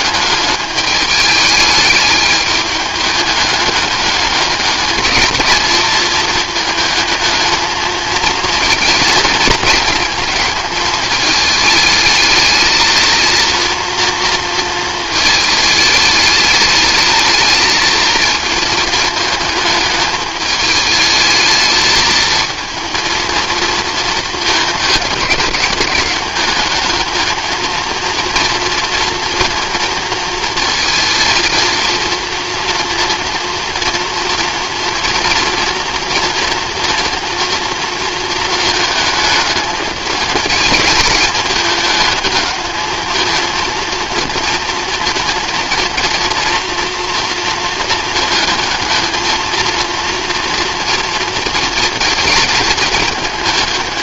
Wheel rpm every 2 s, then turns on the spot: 210, 210, 220, 220, 230, 220, 220, 230, 210, 220, 210, 220, 210, 210, 230, 230, 230, 230, 230, 220, 210, 220, 230, 230, 220, 230, 220.
none